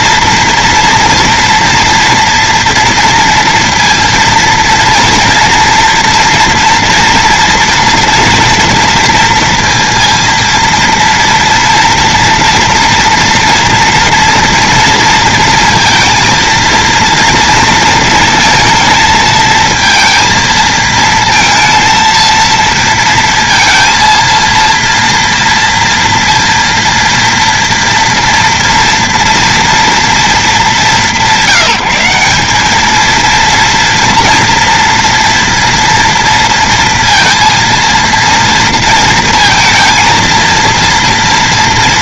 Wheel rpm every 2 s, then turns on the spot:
240, 230, 230, 230, 230, 230, 230, 230, 230, 230, 220, 230, 230, 230, 230, 190, 200, 230, 230, 230, 230.
none